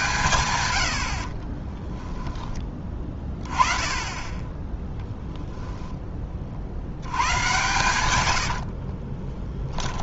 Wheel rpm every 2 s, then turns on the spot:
100, 20, 10, 70, 50.
4-6 8-10